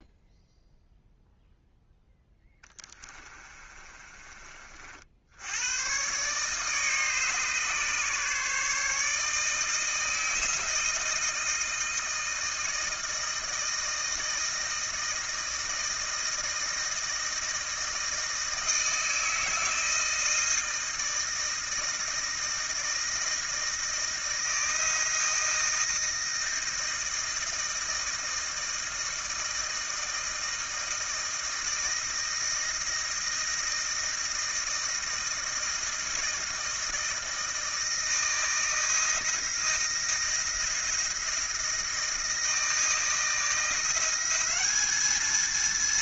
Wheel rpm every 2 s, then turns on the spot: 0, 10, 50, 150, 150, 160, 160, 160, 160, 160, 160, 160, 160, 160, 160, 160, 160, 160, 160, 160, 170, 160, 200.
2-4